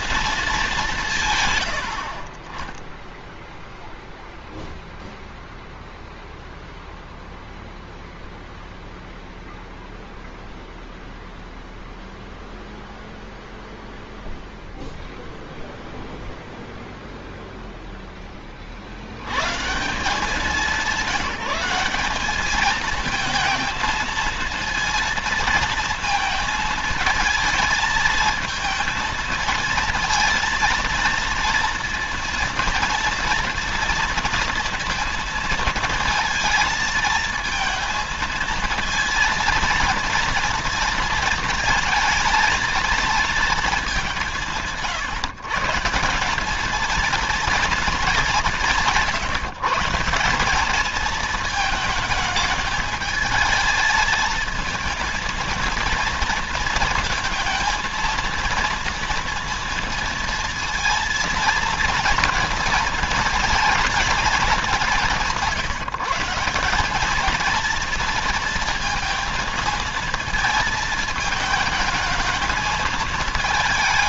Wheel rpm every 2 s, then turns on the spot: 210, 30, 0, 0, 0, 0, 0, 0, 0, 40, 180, 220, 230, 220, 220, 230, 230, 230, 220, 230, 230, 230, 160, 210, 180, 210, 220, 230, 230, 230, 230, 230, 200, 190, 230, 220, 220.
none